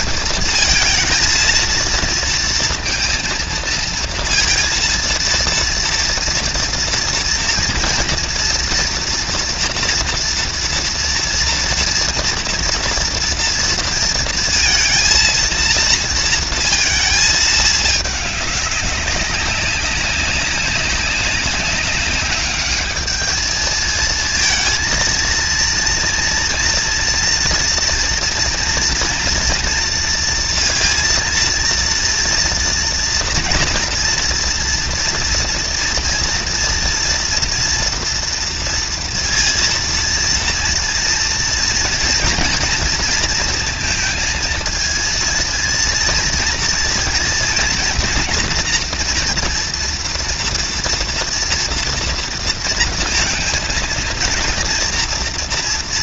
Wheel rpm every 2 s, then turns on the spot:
230, 230, 230, 230, 230, 230, 240, 230, 230, 220, 200, 190, 220, 230, 230, 230, 230, 240, 240, 230, 230, 230, 230, 220, 230, 230, 230, 230.
none